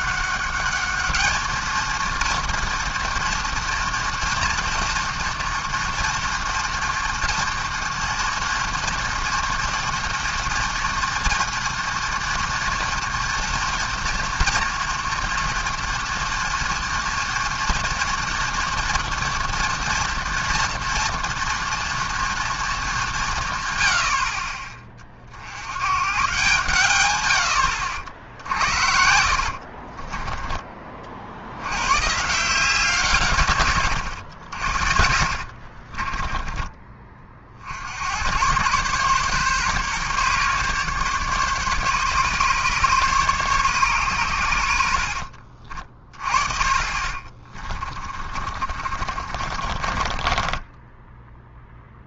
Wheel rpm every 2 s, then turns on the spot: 200, 230, 230, 230, 240, 230, 230, 230, 230, 230, 230, 230, 40, 140, 70, 20, 160, 70, 20, 120, 140, 140, 90, 40, 40, 20.
28-30 48-52